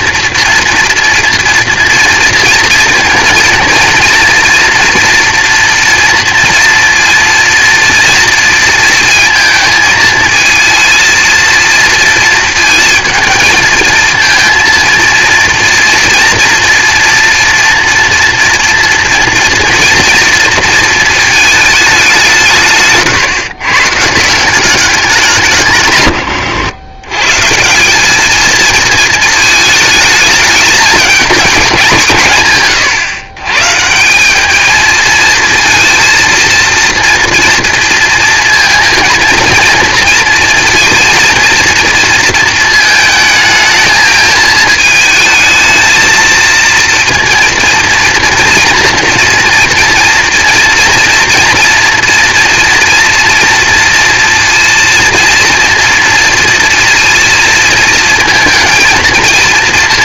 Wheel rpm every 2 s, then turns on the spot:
240, 230, 230, 230, 230, 220, 220, 230, 230, 230, 230, 160, 190, 110, 220, 210, 130, 220, 230, 230, 230, 220, 220, 230, 230, 230, 230, 230, 230, 230.
none